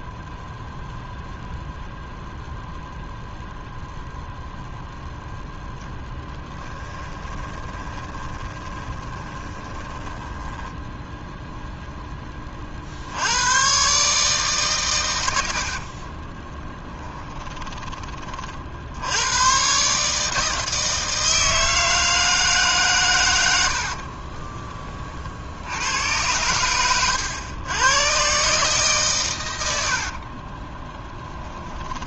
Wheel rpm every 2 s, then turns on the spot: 0, 0, 0, 10, 20, 20, 50, 130, 10, 60, 160, 150, 30, 100, 140, 30.
6-12 16-18 30-32